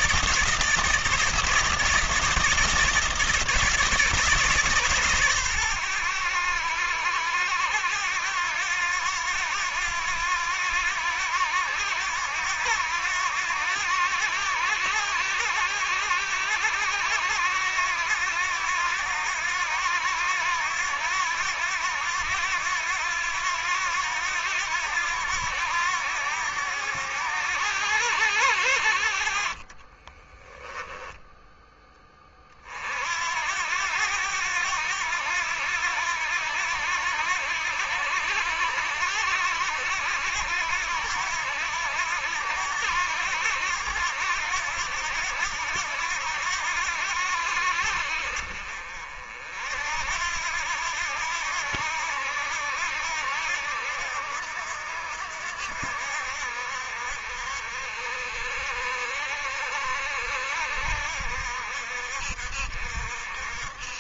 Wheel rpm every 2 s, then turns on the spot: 160, 160, 150, 90, 90, 90, 90, 90, 90, 90, 90, 90, 90, 90, 80, 10, 30, 90, 90, 90, 90, 80, 90, 80, 50, 80, 80, 70, 70, 60, 60, 60.
30-32